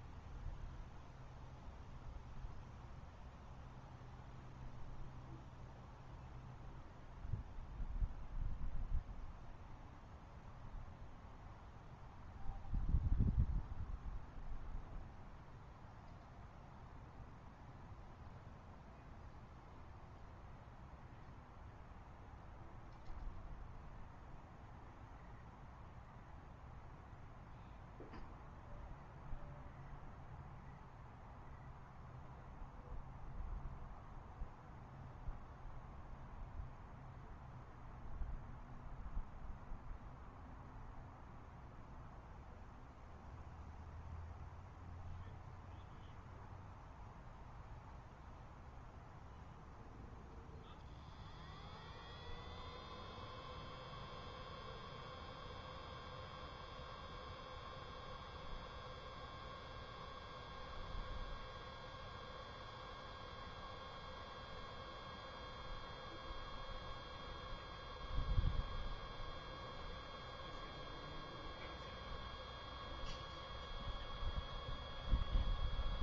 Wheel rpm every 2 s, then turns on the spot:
0, 0, 0, 0, 0, 0, 0, 0, 0, 0, 0, 0, 0, 0, 0, 0, 0, 0, 0, 0, 0, 0, 0, 0, 0, 0, 0, 0, 0, 0, 0, 0, 0, 0, 0, 0, 0, 0.
none